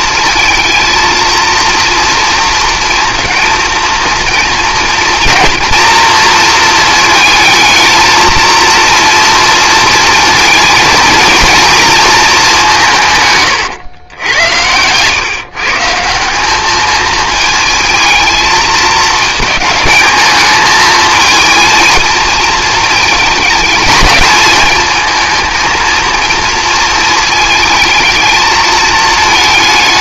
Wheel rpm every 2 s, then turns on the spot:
230, 230, 230, 220, 230, 230, 190, 100, 200, 220, 220, 220, 220, 230, 220.
none